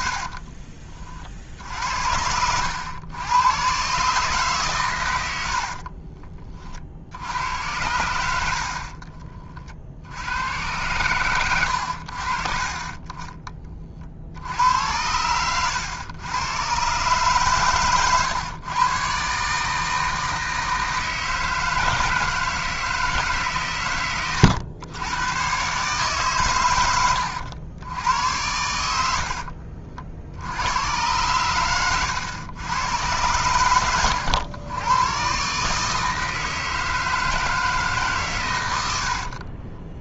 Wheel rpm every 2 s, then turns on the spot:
40, 90, 120, 50, 60, 100, 40, 90, 130, 130, 160, 160, 100, 100, 90, 100, 110, 100, 160, 90.
0-2 8-10 38-40